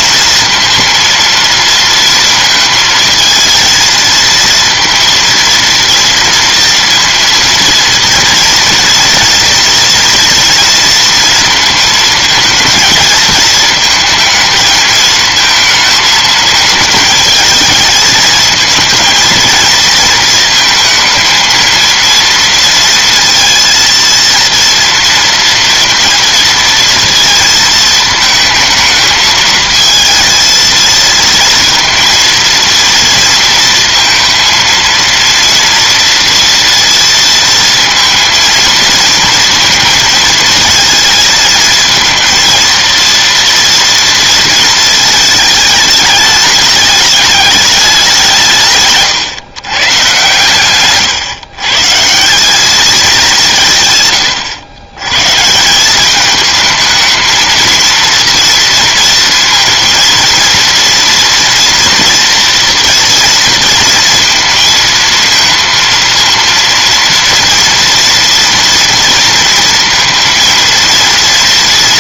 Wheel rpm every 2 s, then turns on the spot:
230, 220, 230, 230, 240, 230, 220, 220, 220, 230, 220, 230, 230, 230, 220, 230, 230, 230, 230, 230, 230, 230, 220, 210, 140, 130, 190, 130, 220, 230, 230, 230, 230, 230, 230, 230.
none